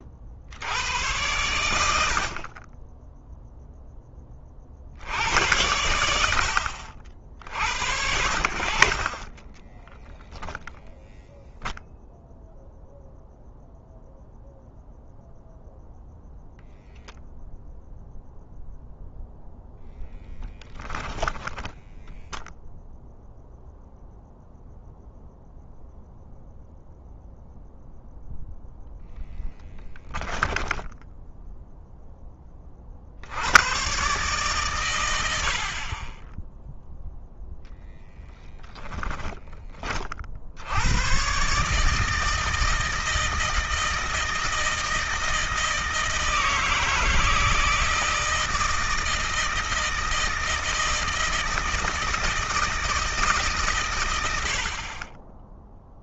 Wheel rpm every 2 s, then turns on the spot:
100, 20, 50, 60, 50, 0, 0, 0, 0, 0, 10, 0, 0, 0, 0, 10, 40, 120, 0, 10, 80, 160, 160, 160, 160, 160, 160, 40.
20-22 30-32 38-40